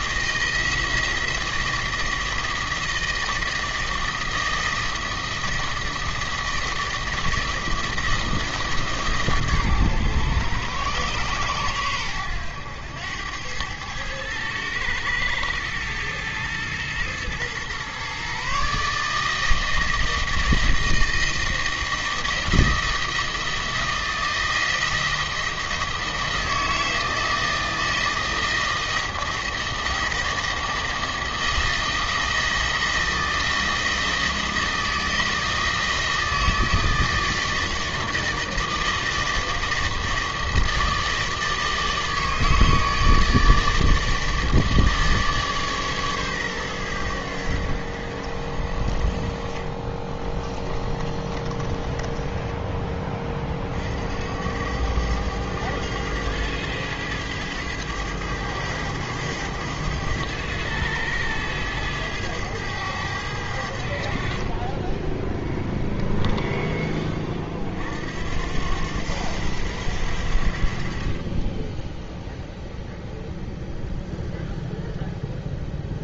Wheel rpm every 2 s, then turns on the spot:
160, 160, 160, 160, 150, 120, 100, 110, 110, 150, 160, 160, 160, 160, 160, 160, 160, 160, 160, 160, 160, 160, 150, 110, 50, 30, 20, 90, 100, 110, 100, 100, 20, 10, 80, 50, 0, 0.
50-52